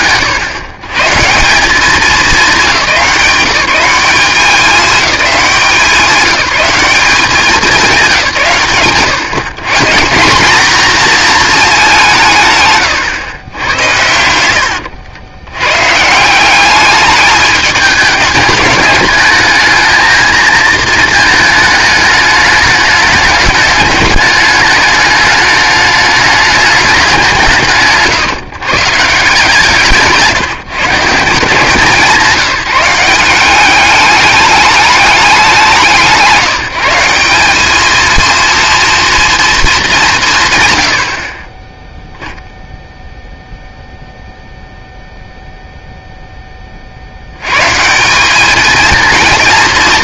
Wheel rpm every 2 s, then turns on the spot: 100, 190, 190, 190, 110, 230, 120, 80, 210, 210, 220, 210, 210, 200, 150, 150, 180, 210, 170, 230, 100, 0, 0, 30, 220.
none